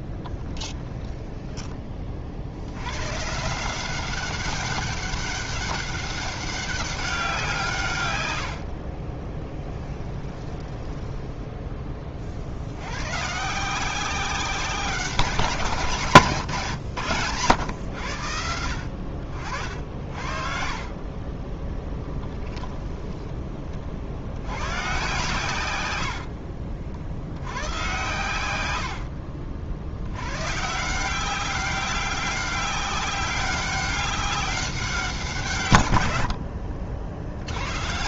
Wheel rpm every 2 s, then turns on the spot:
10, 90, 200, 200, 60, 20, 90, 190, 130, 70, 40, 10, 120, 60, 80, 160, 190, 190, 50.
0-2 8-12 20-22 28-30 36-38